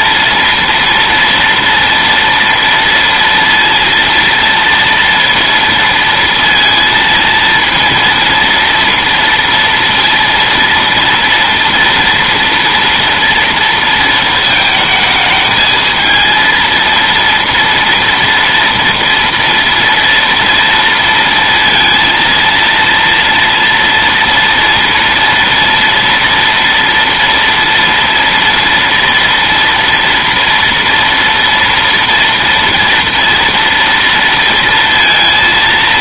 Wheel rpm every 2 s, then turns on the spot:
230, 230, 230, 230, 230, 230, 230, 220, 230, 230, 230, 230, 230, 230, 230, 230, 230, 230.
none